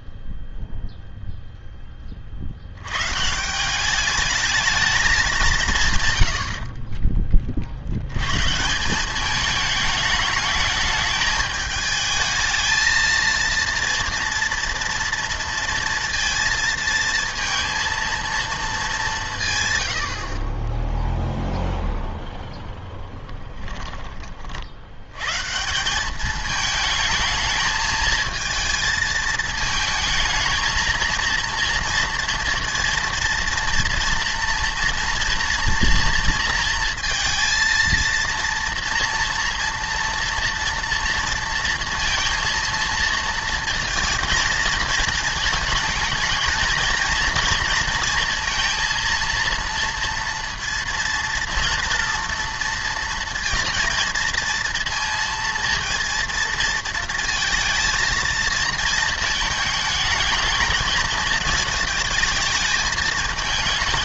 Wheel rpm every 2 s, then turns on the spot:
0, 80, 220, 50, 160, 210, 230, 240, 230, 220, 10, 0, 60, 220, 230, 220, 230, 230, 230, 230, 230, 230, 220, 230, 230, 230, 230, 230, 230, 230, 220, 210.
none